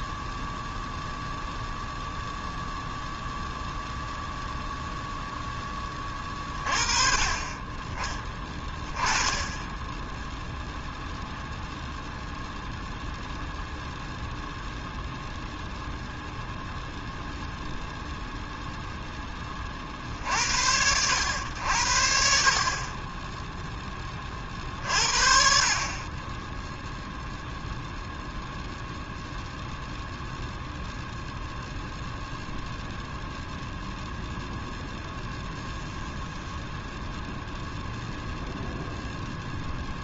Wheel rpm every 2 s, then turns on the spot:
0, 0, 0, 30, 10, 0, 0, 0, 0, 0, 60, 50, 30, 10, 0, 0, 0, 0, 0, 0.
none